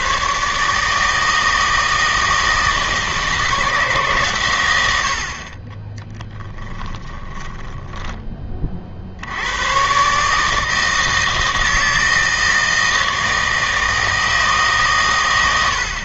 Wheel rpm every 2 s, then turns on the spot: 150, 160, 100, 10, 30, 160, 160, 150.
6-8